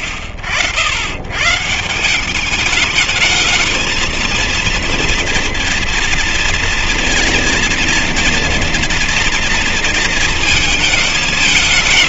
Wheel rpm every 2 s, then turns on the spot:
70, 190, 230, 230, 230, 220.
none